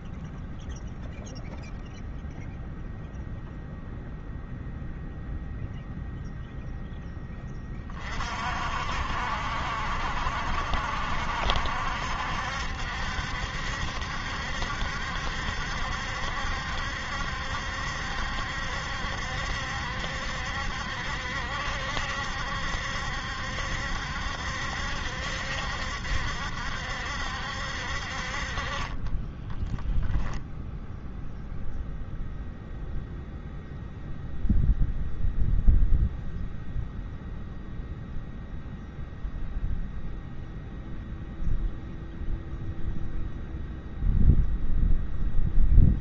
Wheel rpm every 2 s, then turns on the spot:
0, 0, 0, 0, 60, 60, 70, 70, 70, 70, 70, 70, 70, 70, 20, 0, 0, 0, 0, 0, 0, 0, 0.
28-30